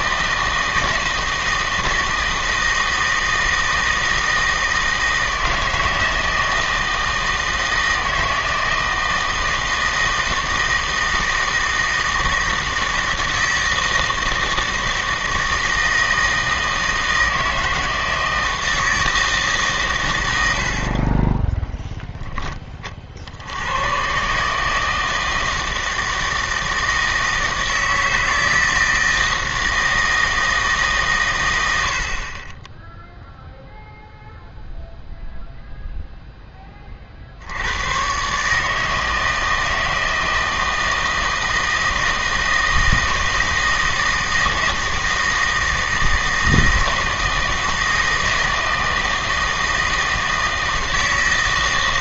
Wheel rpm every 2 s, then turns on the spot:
160, 160, 160, 160, 160, 160, 160, 160, 160, 160, 80, 30, 150, 160, 160, 160, 20, 0, 20, 150, 160, 160, 160, 160, 160, 160.
none